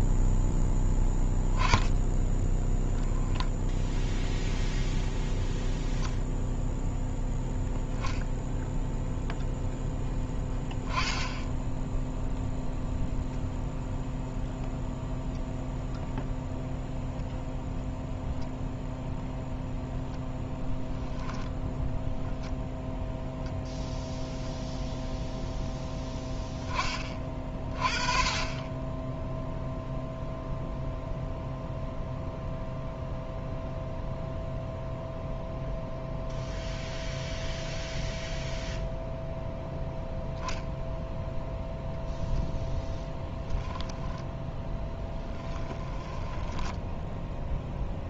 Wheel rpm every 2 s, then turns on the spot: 10, 0, 0, 0, 0, 10, 0, 0, 0, 0, 0, 0, 0, 20, 20, 0, 0, 0, 0, 0, 0, 0, 10, 10.
44-46